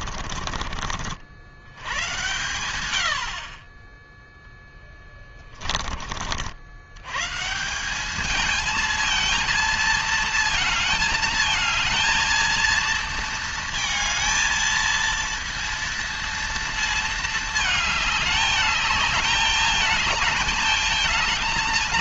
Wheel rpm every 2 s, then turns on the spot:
40, 110, 10, 80, 210, 220, 230, 220, 230, 210, 220.
0-2